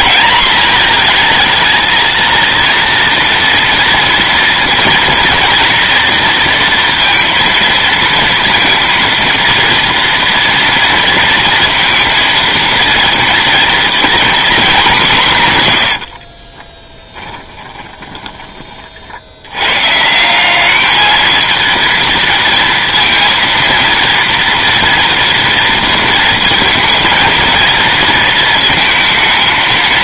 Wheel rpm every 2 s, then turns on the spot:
230, 230, 230, 230, 230, 230, 240, 30, 10, 160, 230, 230, 230, 230, 230.
14-16